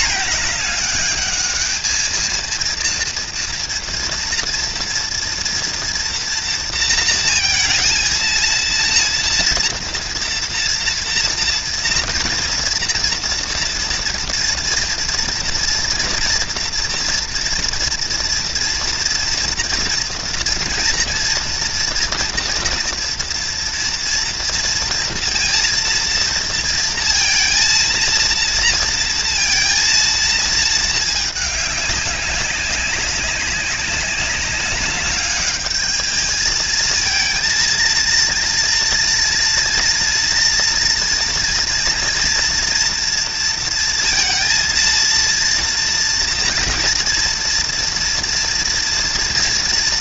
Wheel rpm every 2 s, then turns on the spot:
210, 230, 230, 230, 230, 230, 230, 230, 230, 230, 230, 230, 230, 230, 230, 220, 190, 200, 220, 230, 240, 230, 230, 230, 230.
none